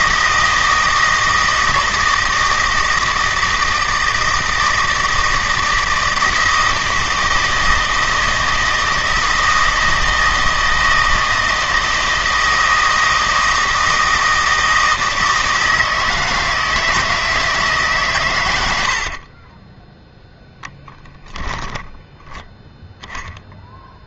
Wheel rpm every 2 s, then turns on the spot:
160, 160, 160, 160, 160, 160, 160, 160, 160, 80, 10, 0.
20-22